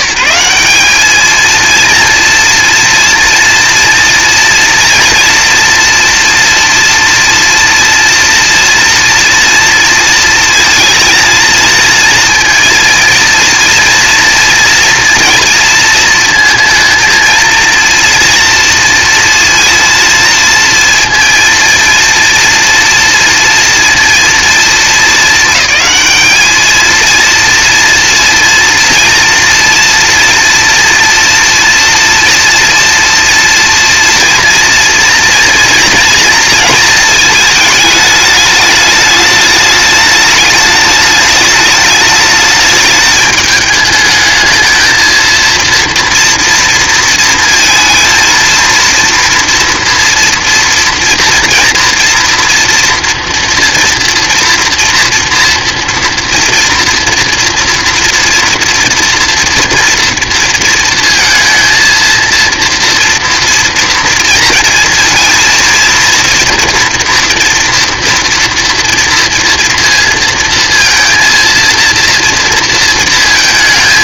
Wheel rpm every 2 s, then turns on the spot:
210, 230, 240, 230, 230, 230, 230, 230, 230, 230, 230, 230, 210, 230, 240, 230, 240, 230, 220, 210, 210, 210, 230, 230, 230, 240, 230, 230, 230, 230, 230, 230, 230, 230, 230, 230, 230.
none